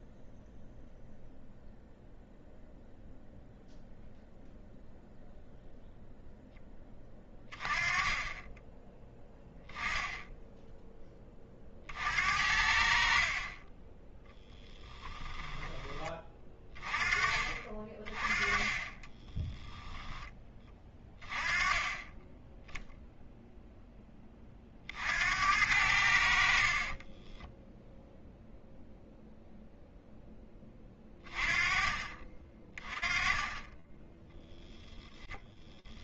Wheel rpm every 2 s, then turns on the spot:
0, 0, 0, 0, 20, 10, 60, 10, 20, 20, 10, 10, 20, 60, 0, 10, 30, 10.
34-36